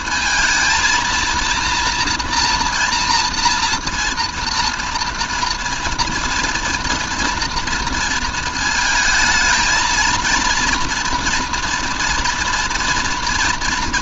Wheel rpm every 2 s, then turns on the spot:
220, 230, 230, 230, 220, 230, 230.
none